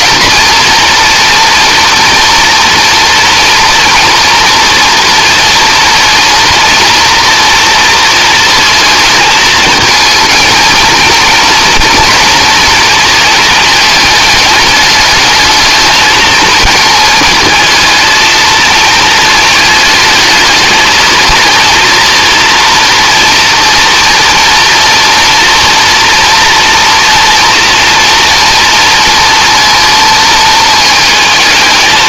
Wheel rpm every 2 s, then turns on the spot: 240, 230, 230, 230, 230, 230, 230, 210, 220, 220, 220, 230, 240, 230, 230, 220.
none